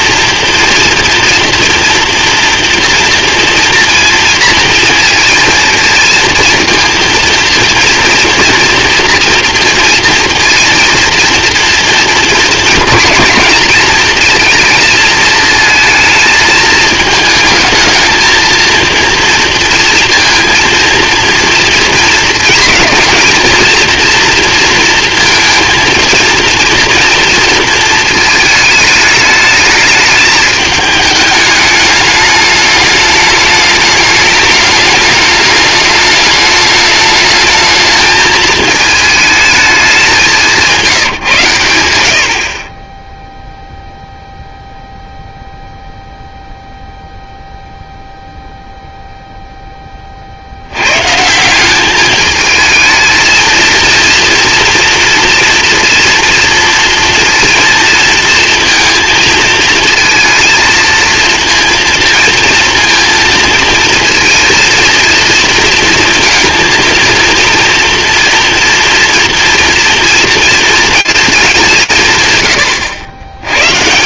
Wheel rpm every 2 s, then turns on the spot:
230, 230, 230, 230, 230, 230, 240, 230, 220, 230, 230, 220, 230, 230, 210, 210, 210, 210, 210, 220, 180, 30, 0, 0, 0, 80, 220, 230, 230, 230, 230, 230, 230, 230, 230, 230, 100.
none